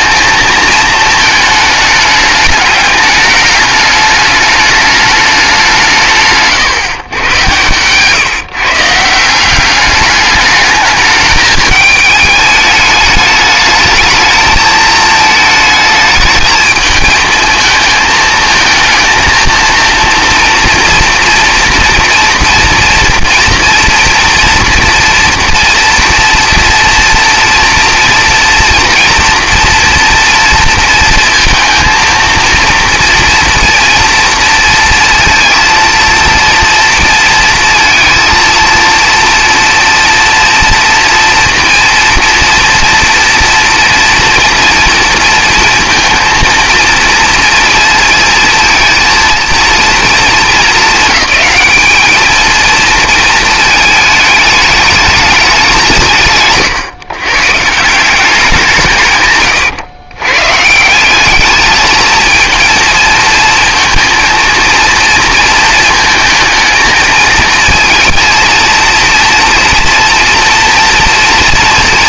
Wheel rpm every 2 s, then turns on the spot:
220, 210, 210, 140, 150, 210, 210, 220, 220, 220, 230, 230, 230, 230, 240, 230, 230, 230, 230, 230, 240, 230, 230, 220, 230, 210, 220, 210, 140, 170, 160, 230, 230, 220, 230, 230.
none